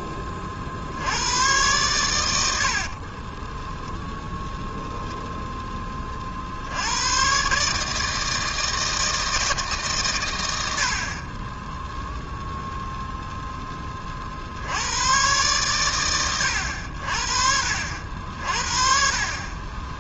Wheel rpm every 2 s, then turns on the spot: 40, 80, 0, 60, 160, 90, 0, 60, 100, 60.
2-4